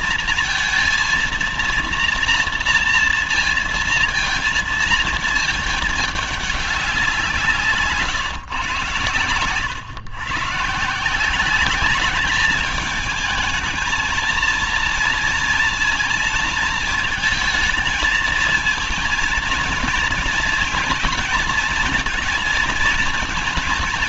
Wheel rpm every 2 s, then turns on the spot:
230, 230, 230, 200, 130, 140, 210, 230, 230, 220, 230, 220.
none